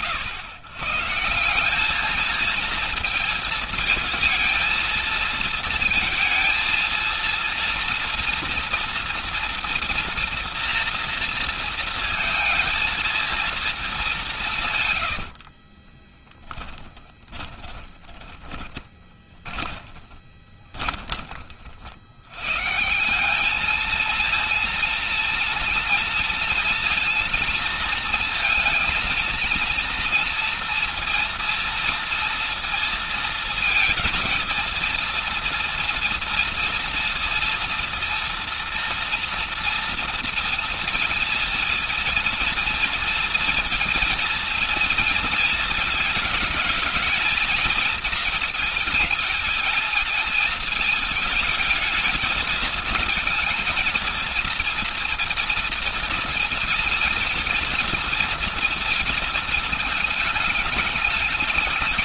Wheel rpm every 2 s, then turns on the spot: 100, 230, 230, 230, 230, 230, 220, 140, 10, 20, 20, 150, 230, 230, 230, 230, 230, 230, 230, 230, 230, 230, 230, 210, 220, 220, 220, 230, 230, 230, 210.
14-22